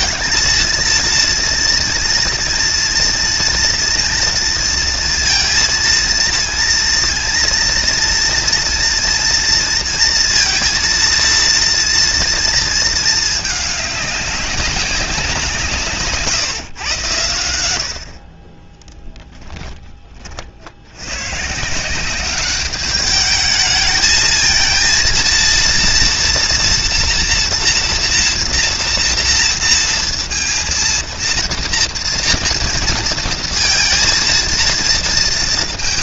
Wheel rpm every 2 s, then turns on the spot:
220, 230, 230, 230, 230, 230, 230, 200, 130, 30, 40, 200, 220, 240, 240, 230, 230, 230.
18-20